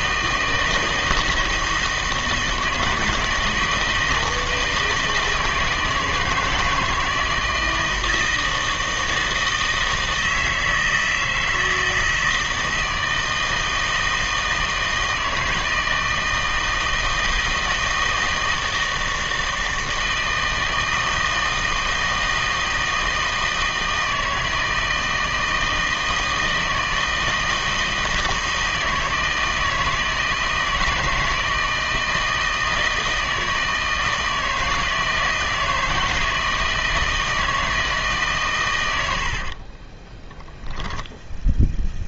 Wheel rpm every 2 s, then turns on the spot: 160, 160, 160, 160, 160, 160, 160, 160, 160, 160, 160, 160, 160, 160, 160, 160, 160, 160, 160, 130, 0.
none